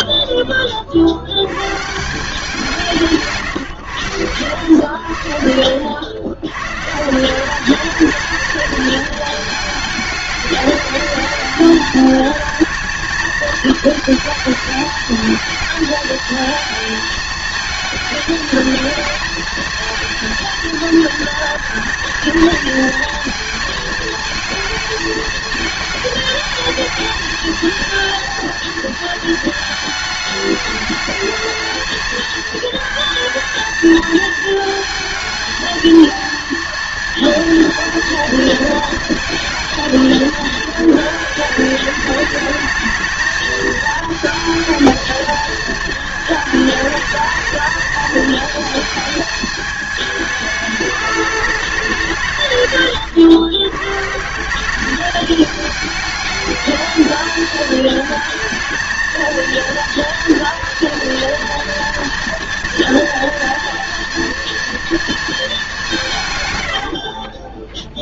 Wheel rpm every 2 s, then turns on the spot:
40, 180, 80, 130, 210, 210, 220, 220, 220, 220, 230, 220, 220, 220, 230, 220, 220, 220, 230, 230, 220, 220, 220, 220, 220, 210, 130, 190, 220, 220, 230, 230, 230, 90.
66-68